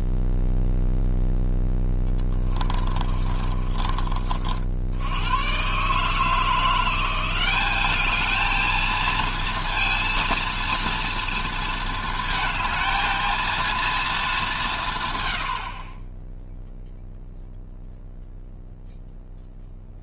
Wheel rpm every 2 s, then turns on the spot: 0, 20, 50, 170, 220, 230, 220, 190, 0, 0.
2-4